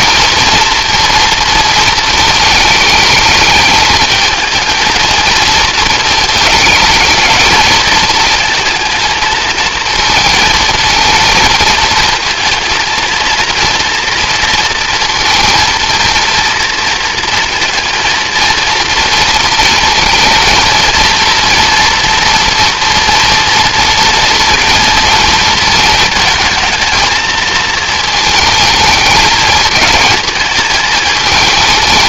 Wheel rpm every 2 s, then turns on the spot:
230, 220, 230, 210, 220, 230, 230, 230, 230, 230, 230, 230, 230, 230, 210, 220.
none